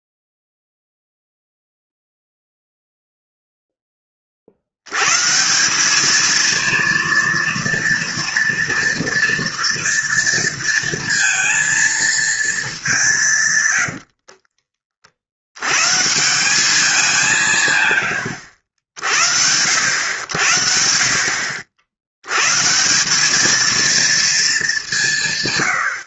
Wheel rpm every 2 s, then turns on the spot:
0, 0, 20, 210, 240, 240, 230, 80, 150, 110, 80, 100, 230.
14-16